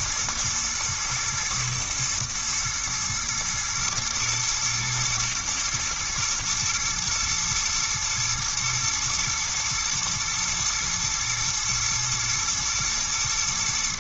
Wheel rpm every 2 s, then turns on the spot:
120, 120, 110, 120, 120, 120, 120.
none